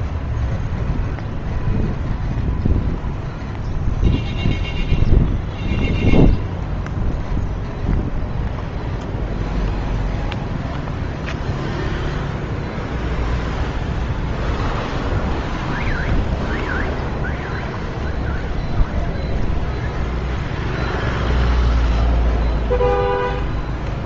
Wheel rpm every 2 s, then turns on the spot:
0, 0, 0, 0, 0, 0, 0, 0, 0, 0, 0, 0.
none